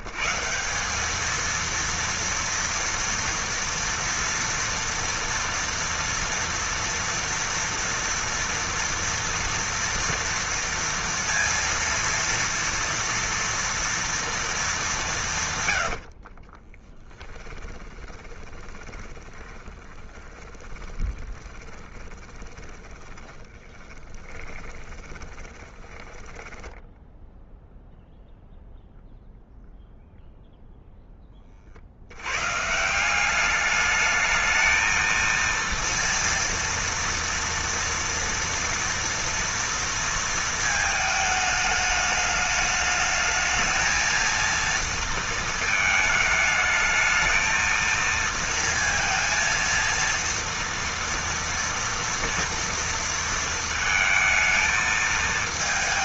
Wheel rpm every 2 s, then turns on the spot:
150, 230, 230, 230, 240, 230, 230, 230, 40, 20, 20, 20, 20, 10, 0, 0, 130, 220, 230, 230, 220, 210, 230, 220, 230, 230, 230, 220.
16-28